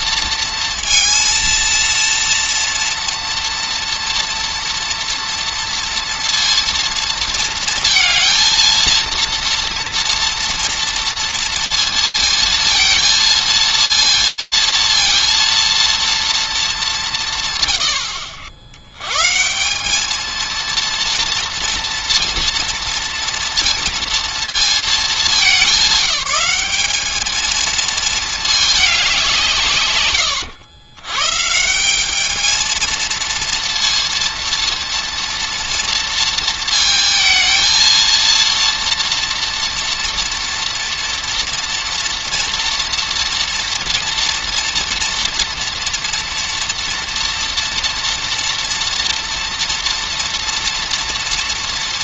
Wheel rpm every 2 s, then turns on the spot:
230, 230, 230, 230, 230, 230, 230, 230, 220, 70, 230, 230, 230, 200, 220, 110, 220, 230, 230, 230, 230, 240, 230, 230, 230, 230.
none